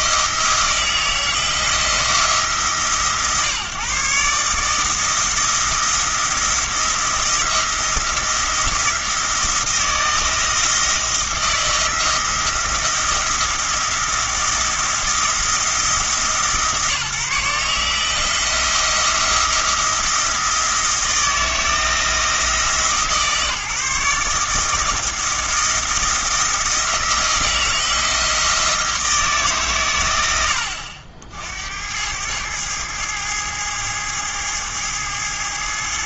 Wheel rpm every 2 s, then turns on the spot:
160, 140, 160, 170, 170, 160, 170, 170, 140, 170, 160, 150, 160, 160, 160, 80, 110, 110.
none